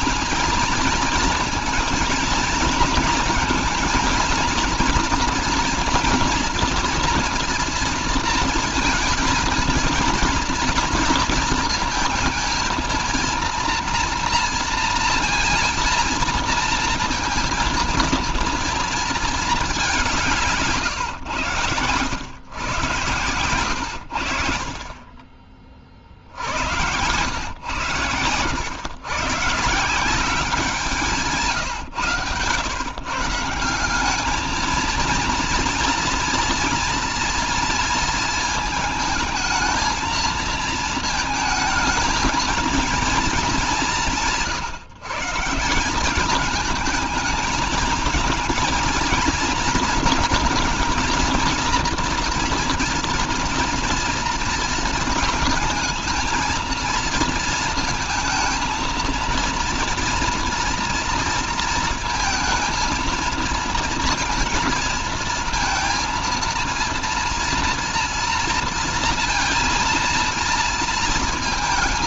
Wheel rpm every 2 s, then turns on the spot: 230, 220, 240, 230, 230, 230, 230, 230, 230, 230, 140, 130, 40, 100, 120, 170, 130, 220, 230, 220, 230, 220, 150, 220, 230, 230, 240, 230, 220, 230, 230, 230, 230, 230, 230, 230.
none